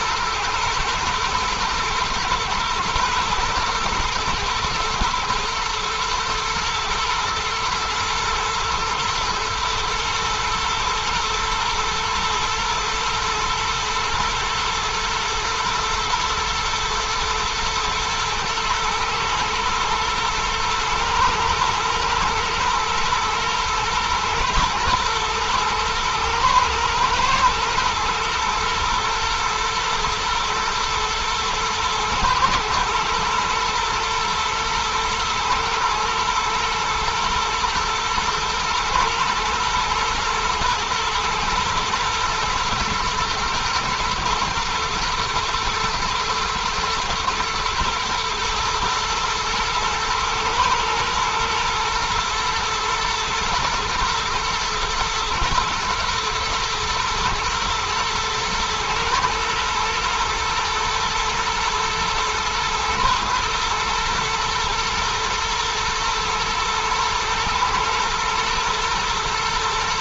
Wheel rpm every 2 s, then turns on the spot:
120, 120, 120, 120, 110, 110, 110, 110, 110, 110, 120, 120, 110, 120, 120, 120, 110, 110, 120, 110, 110, 120, 120, 120, 110, 120, 120, 110, 110, 110, 110, 110, 120, 120, 110.
none